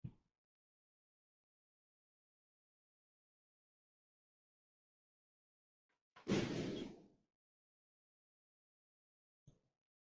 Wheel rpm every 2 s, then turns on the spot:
0, 0, 0, 0, 0.
none